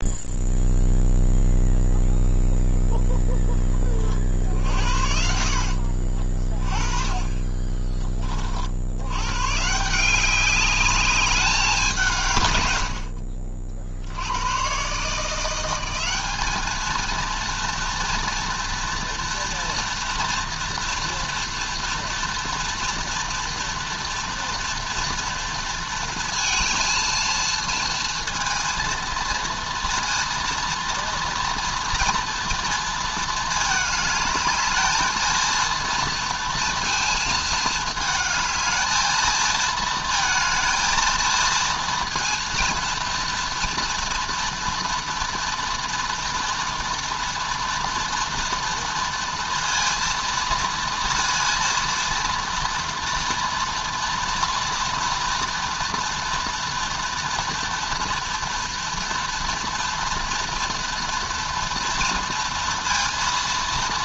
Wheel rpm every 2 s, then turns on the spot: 0, 10, 60, 20, 90, 200, 80, 140, 220, 230, 230, 230, 230, 230, 230, 230, 230, 220, 230, 220, 220, 230, 230, 230, 230, 230, 230, 230, 230, 230, 240, 230.
4-6 12-14